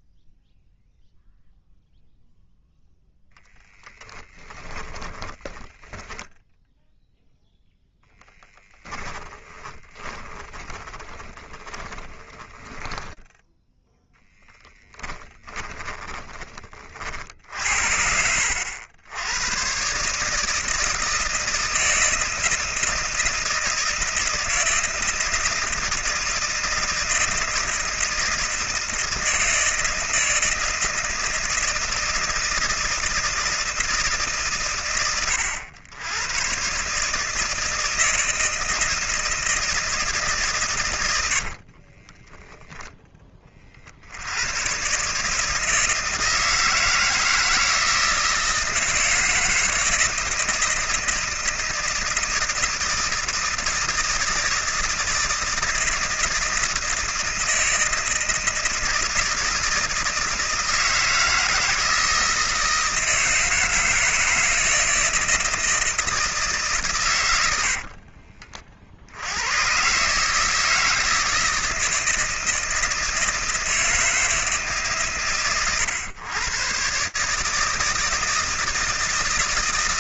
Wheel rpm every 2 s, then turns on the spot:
0, 10, 20, 0, 10, 30, 10, 10, 30, 80, 160, 160, 170, 160, 160, 160, 160, 110, 130, 160, 120, 0, 110, 160, 160, 160, 160, 160, 160, 160, 160, 160, 160, 150, 40, 160, 160, 140, 130, 160.
4-6 8-16